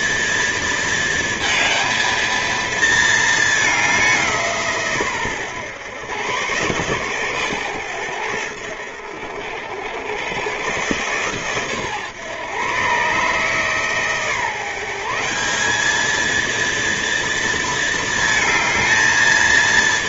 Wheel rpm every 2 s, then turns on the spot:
230, 220, 130, 120, 80, 130, 140, 190, 230, 230.
none